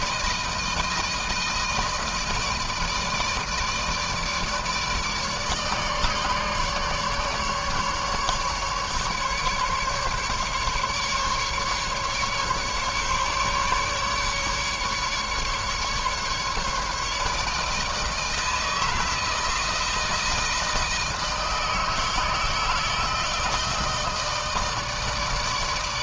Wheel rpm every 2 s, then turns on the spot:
160, 160, 160, 150, 150, 150, 140, 140, 150, 160, 160, 160, 160.
none